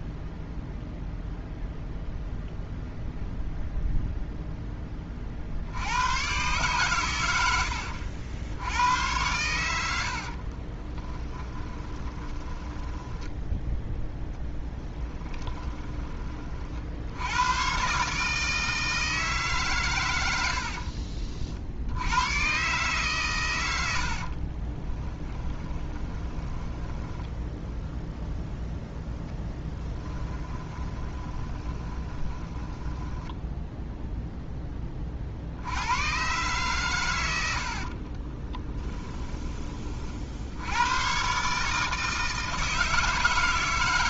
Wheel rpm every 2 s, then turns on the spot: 0, 0, 10, 120, 90, 30, 10, 10, 60, 160, 50, 130, 20, 10, 0, 20, 10, 10, 130, 20, 100, 160.
10-16 20-22 24-28 30-34 38-40